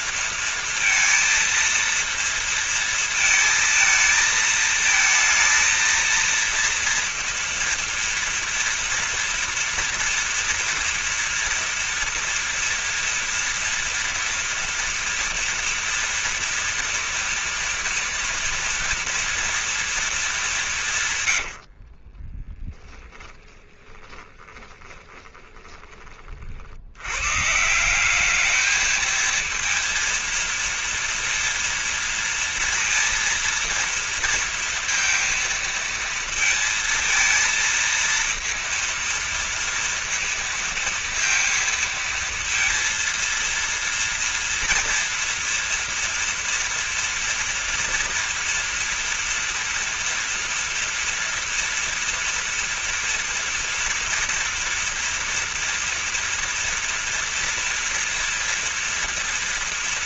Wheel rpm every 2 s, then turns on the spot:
230, 230, 230, 230, 230, 230, 230, 230, 240, 230, 200, 20, 20, 60, 210, 230, 230, 230, 230, 230, 230, 230, 230, 240, 240, 240, 230, 230, 230, 240.
22-26